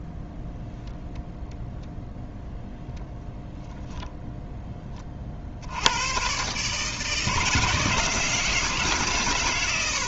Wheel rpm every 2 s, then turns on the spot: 10, 0, 10, 140, 160.
none